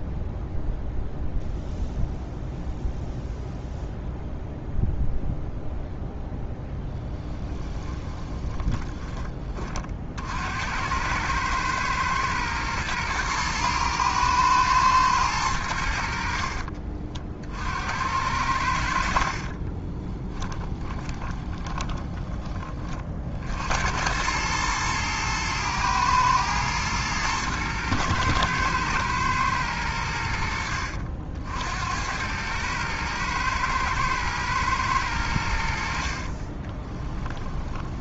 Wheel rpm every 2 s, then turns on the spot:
0, 0, 0, 10, 20, 90, 120, 110, 40, 60, 20, 40, 110, 110, 110, 70, 110, 100, 20.
8-10 20-22 36-38